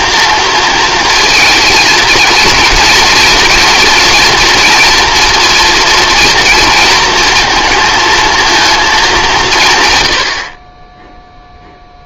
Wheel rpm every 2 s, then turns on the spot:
230, 230, 230, 230, 230, 40.
none